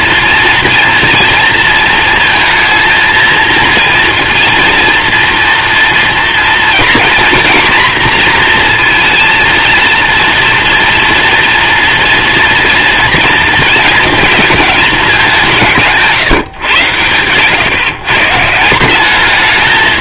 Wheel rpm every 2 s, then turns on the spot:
230, 230, 230, 240, 240, 230, 230, 220, 130, 160.
none